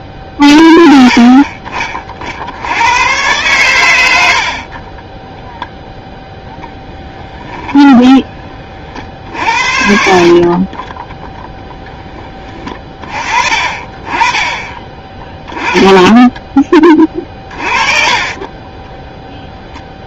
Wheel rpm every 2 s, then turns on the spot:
20, 80, 40, 0, 30, 30, 30, 20, 10, 20.
none